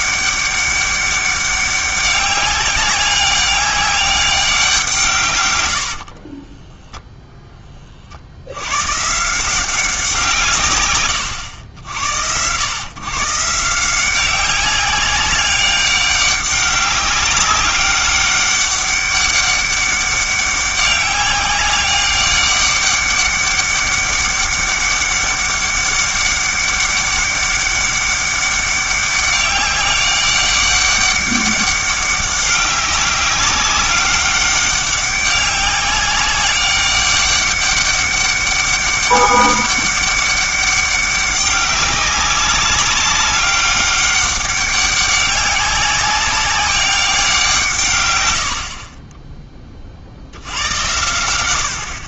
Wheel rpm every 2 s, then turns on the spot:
200, 200, 180, 10, 100, 120, 120, 190, 200, 200, 200, 200, 200, 200, 200, 200, 190, 200, 200, 200, 200, 200, 200, 200, 50, 90.
6-8 48-50